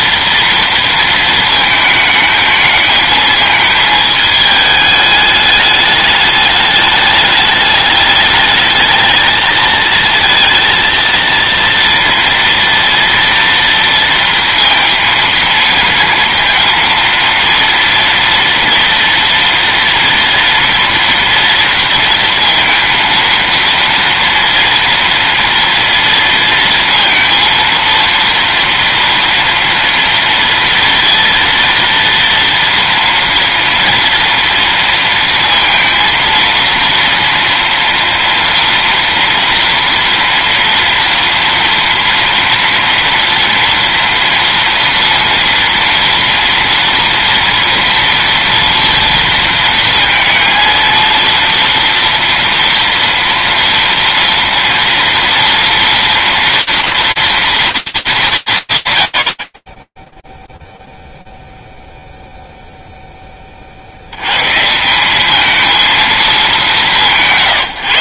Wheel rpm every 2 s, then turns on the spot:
230, 220, 220, 210, 220, 220, 240, 230, 230, 230, 230, 230, 230, 230, 230, 230, 230, 230, 230, 230, 230, 230, 230, 230, 230, 230, 230, 230, 230, 120, 0, 0, 160, 170.
none